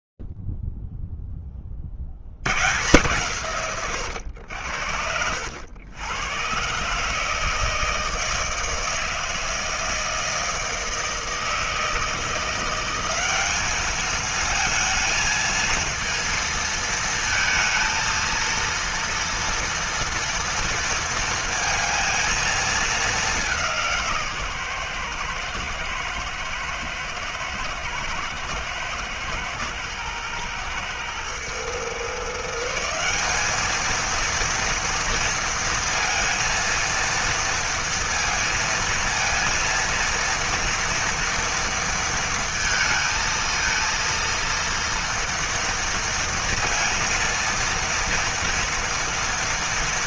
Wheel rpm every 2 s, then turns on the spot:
0, 80, 90, 130, 160, 160, 170, 220, 230, 230, 230, 220, 130, 110, 120, 110, 190, 230, 230, 230, 230, 220, 230, 230, 230.
none